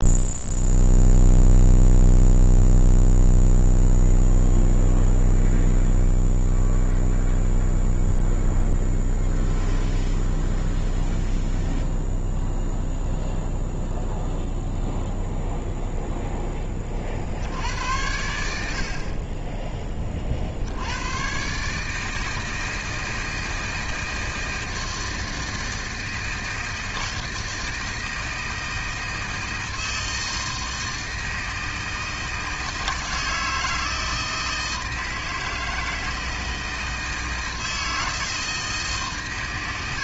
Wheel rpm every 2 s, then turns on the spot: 0, 0, 0, 0, 0, 0, 0, 0, 20, 60, 60, 160, 160, 160, 160, 160, 160, 160, 160, 160.
none